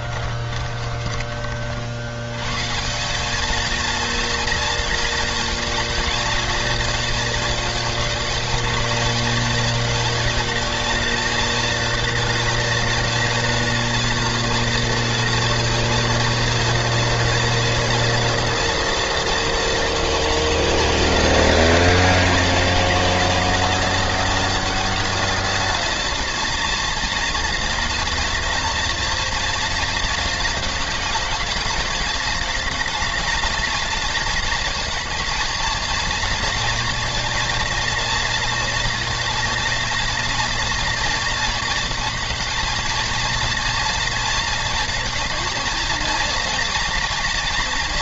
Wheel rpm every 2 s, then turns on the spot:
50, 150, 230, 230, 220, 230, 230, 230, 230, 230, 230, 230, 230, 230, 230, 210, 220, 220, 230, 230, 230, 220, 230, 230.
0-2